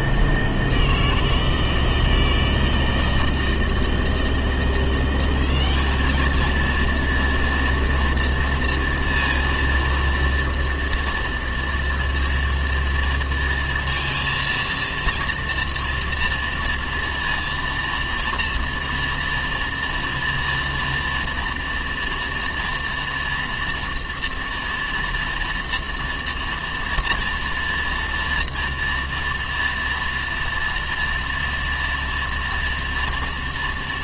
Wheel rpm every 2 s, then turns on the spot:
150, 160, 160, 210, 230, 230, 230, 230, 240, 230, 230, 230, 230, 230, 230, 230, 230.
none